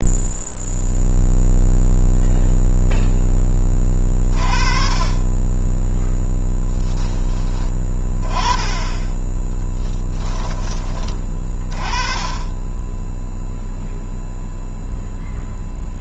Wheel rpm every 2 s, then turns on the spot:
0, 0, 20, 10, 10, 20, 10, 0.
none